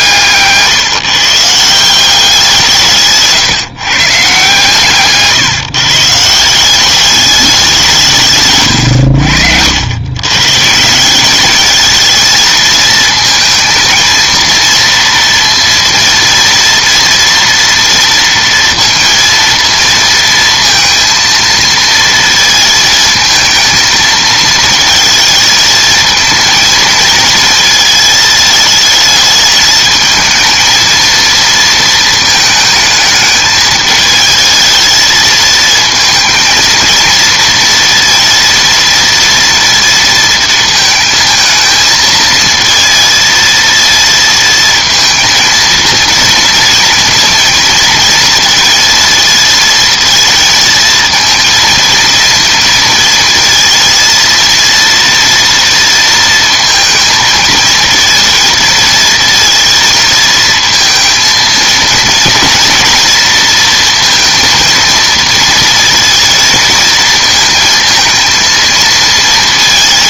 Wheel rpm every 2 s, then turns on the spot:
160, 180, 140, 170, 130, 140, 230, 230, 230, 230, 230, 230, 220, 220, 220, 220, 220, 220, 230, 230, 230, 230, 230, 230, 230, 230, 230, 230, 230, 230, 220, 230, 230, 230, 230.
0-2